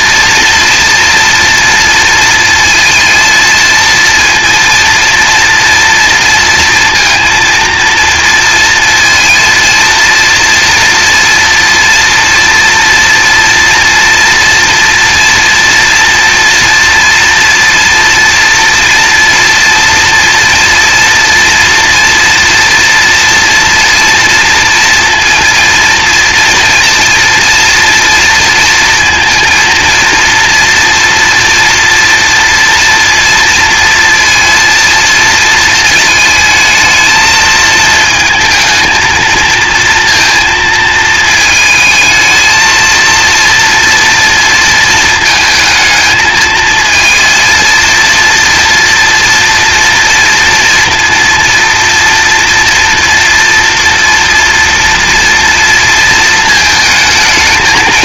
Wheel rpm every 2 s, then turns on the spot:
230, 230, 230, 230, 230, 240, 240, 230, 230, 230, 230, 230, 230, 230, 230, 230, 230, 230, 220, 220, 230, 220, 230, 220, 240, 230, 240, 230, 220.
none